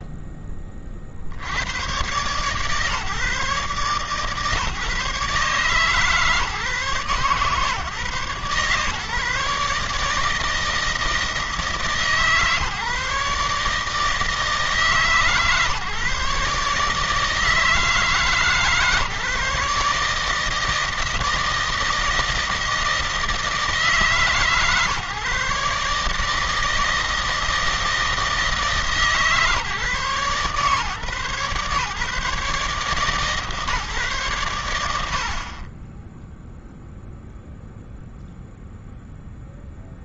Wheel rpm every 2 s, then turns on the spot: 20, 130, 130, 150, 140, 160, 150, 150, 140, 150, 160, 160, 150, 160, 160, 140, 140, 90, 0, 0.
none